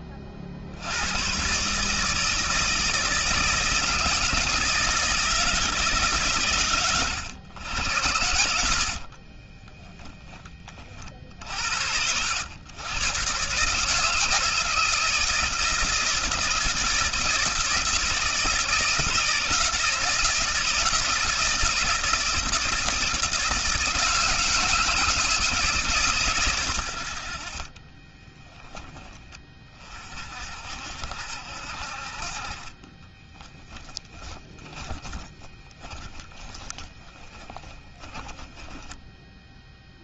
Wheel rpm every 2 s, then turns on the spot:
100, 160, 160, 100, 50, 50, 120, 160, 160, 160, 160, 160, 160, 80, 20, 60, 20, 20, 20, 10.
8-10 32-40